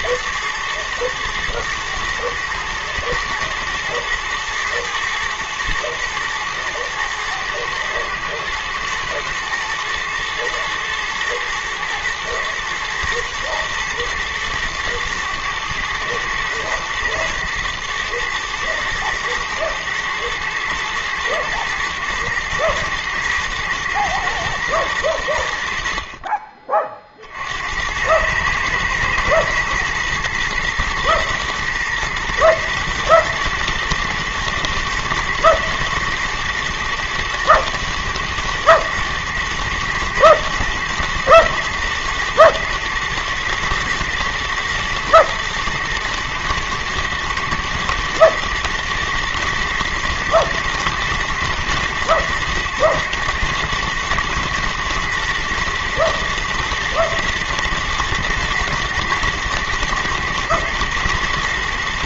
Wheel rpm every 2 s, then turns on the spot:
110, 110, 120, 110, 110, 110, 120, 110, 120, 110, 110, 110, 110, 30, 110, 110, 110, 120, 120, 110, 110, 110, 110, 110, 110, 120, 110, 120, 110, 110, 120.
none